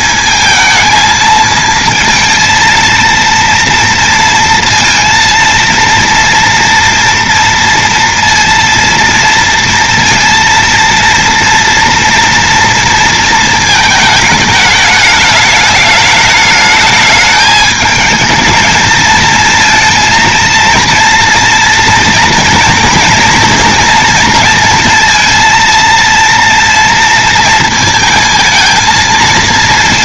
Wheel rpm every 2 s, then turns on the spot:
220, 230, 230, 240, 230, 230, 230, 210, 210, 220, 230, 230, 230, 230, 230.
none